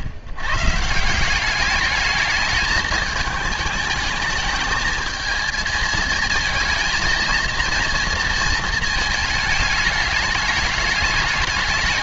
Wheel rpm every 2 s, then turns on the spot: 90, 220, 210, 230, 230, 210.
none